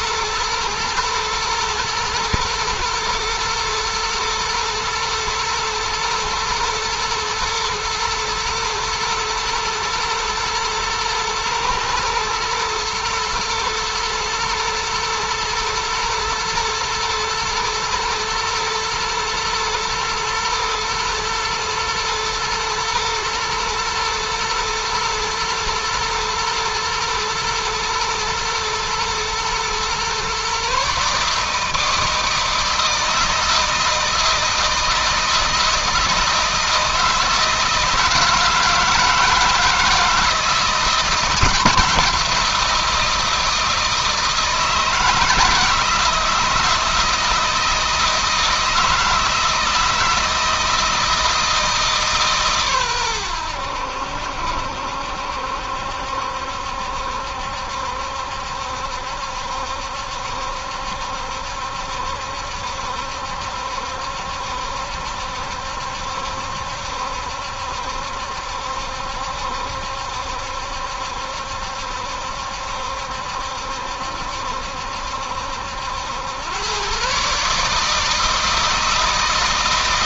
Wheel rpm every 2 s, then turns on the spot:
120, 110, 120, 110, 110, 110, 110, 110, 120, 120, 110, 120, 120, 110, 110, 140, 160, 160, 160, 160, 170, 170, 160, 160, 160, 160, 120, 70, 70, 70, 70, 70, 70, 70, 70, 70, 70, 70, 120, 160.
none